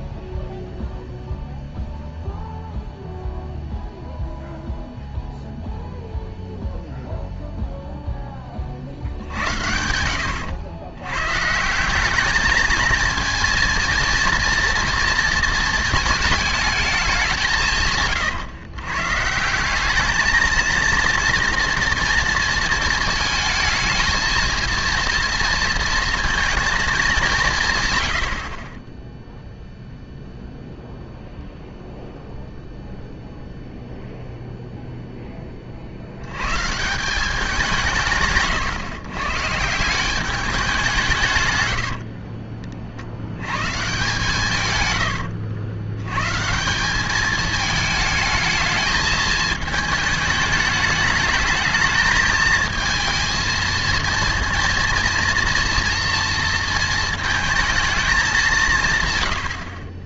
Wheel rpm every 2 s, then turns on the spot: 0, 0, 0, 0, 40, 110, 220, 230, 220, 120, 230, 230, 230, 220, 40, 0, 0, 0, 140, 140, 190, 40, 130, 170, 220, 210, 220, 230, 230, 170.
none